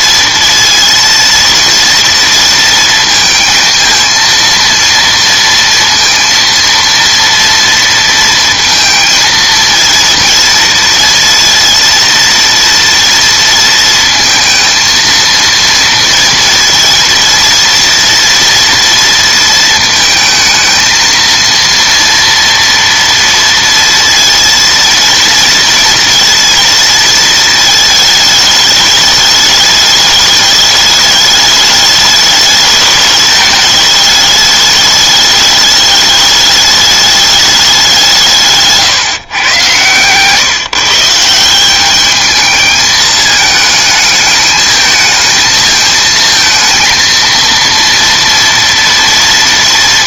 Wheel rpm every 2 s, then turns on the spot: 230, 230, 230, 230, 230, 220, 230, 230, 230, 230, 220, 230, 230, 230, 210, 210, 210, 210, 210, 150, 150, 220, 210, 230, 230.
38-40